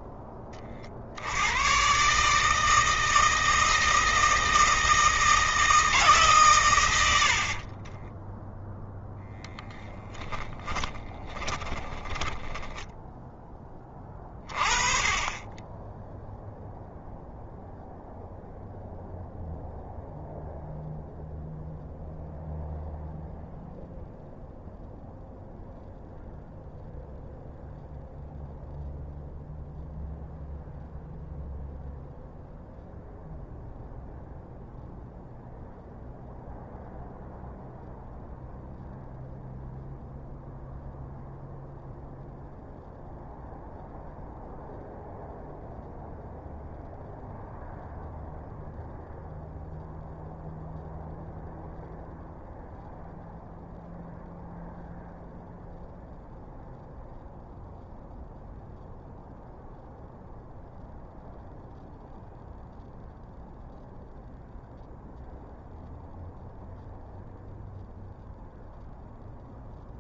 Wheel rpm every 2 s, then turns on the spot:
50, 160, 160, 100, 0, 30, 10, 30, 0, 0, 0, 0, 0, 0, 0, 0, 0, 0, 0, 0, 0, 0, 0, 0, 0, 0, 0, 0, 0, 0, 0, 0, 0, 0, 0.
10-14